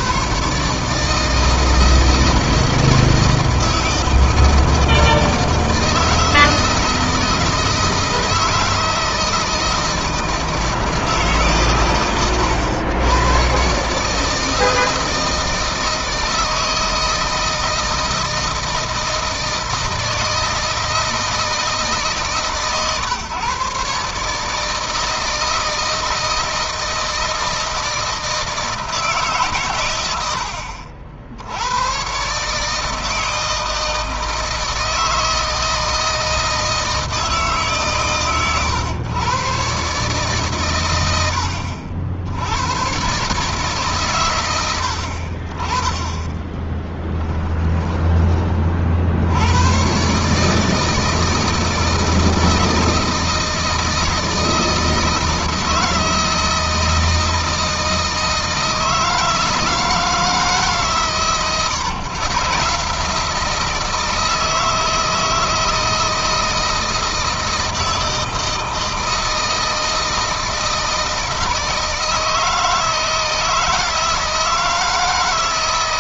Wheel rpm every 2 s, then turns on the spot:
140, 160, 160, 160, 160, 160, 100, 160, 160, 160, 160, 140, 150, 160, 160, 80, 150, 160, 160, 120, 120, 90, 90, 20, 40, 150, 160, 160, 170, 160, 150, 150, 160, 160, 160, 160, 160, 160.
46-48